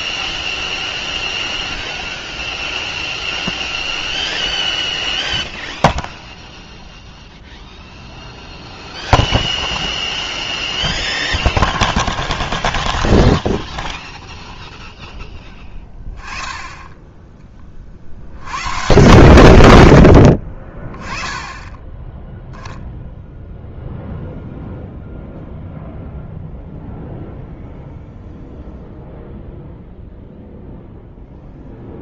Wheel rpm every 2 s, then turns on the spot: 0, 0, 0, 0, 0, 0, 0, 0, 10, 100, 50, 0, 0, 0, 0, 0.
none